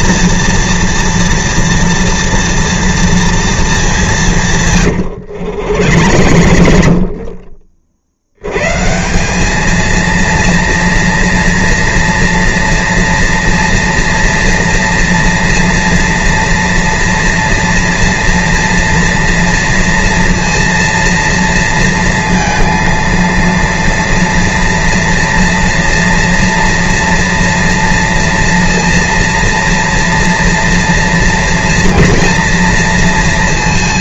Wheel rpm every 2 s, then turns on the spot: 230, 230, 170, 80, 80, 230, 230, 230, 240, 230, 230, 230, 230, 230, 230, 230, 230.
6-8